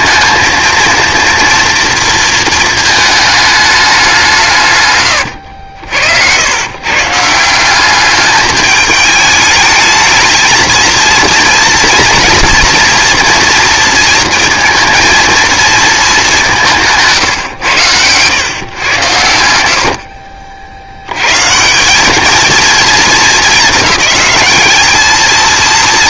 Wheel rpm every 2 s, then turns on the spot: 230, 220, 140, 120, 210, 230, 240, 230, 160, 120, 80, 220, 210.
none